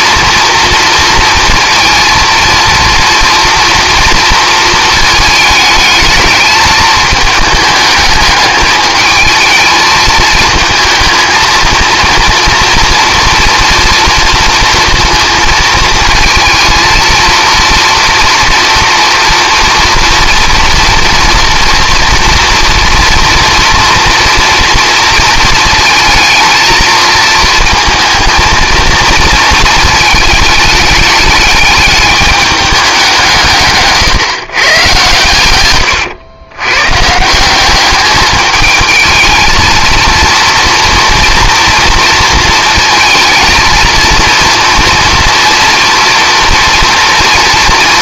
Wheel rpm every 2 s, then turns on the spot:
230, 230, 220, 210, 210, 220, 230, 230, 220, 240, 230, 240, 230, 230, 230, 210, 200, 120, 130, 220, 230, 230, 230, 240.
none